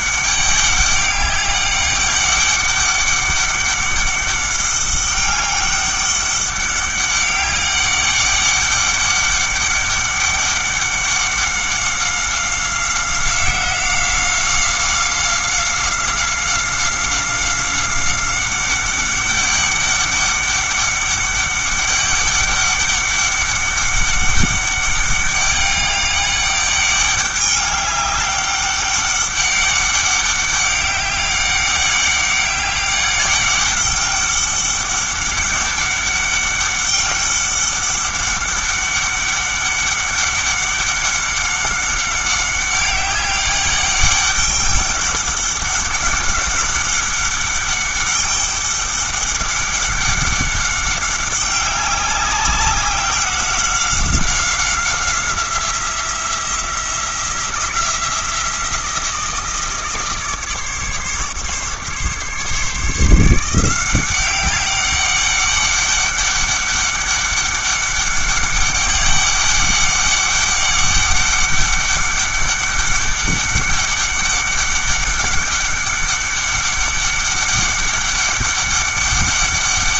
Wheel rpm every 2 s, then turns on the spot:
200, 200, 200, 200, 200, 200, 190, 190, 190, 190, 200, 200, 200, 200, 200, 200, 200, 200, 200, 200, 200, 200, 200, 200, 200, 200, 190, 180, 170, 170, 150, 160, 200, 200, 200, 200, 200, 200, 200, 200.
none